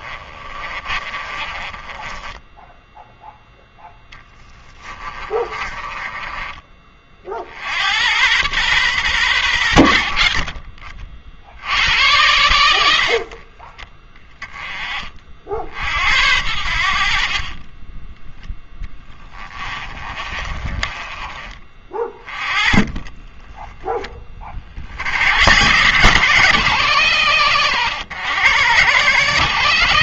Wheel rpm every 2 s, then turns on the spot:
30, 0, 10, 30, 120, 40, 90, 30, 70, 10, 30, 20, 40, 170, 140.
0-2 4-6 20-24